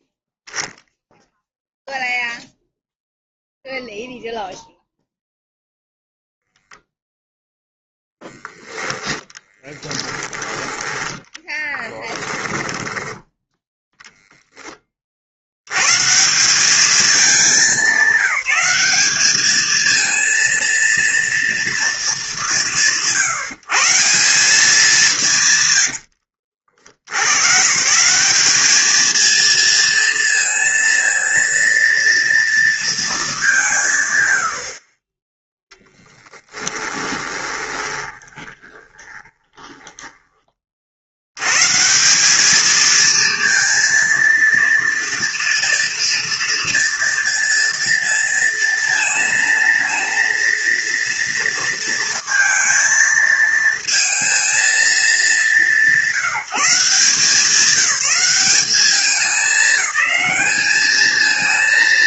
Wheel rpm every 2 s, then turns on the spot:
0, 0, 0, 0, 10, 10, 20, 20, 200, 210, 230, 170, 190, 70, 210, 230, 230, 60, 20, 20, 30, 210, 230, 240, 230, 230, 230, 220, 180, 200, 210.
12-14 36-40